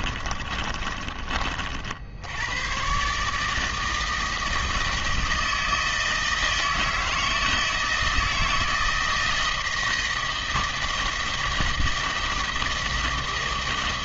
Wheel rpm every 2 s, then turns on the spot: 30, 110, 160, 160, 160, 160, 160.
0-2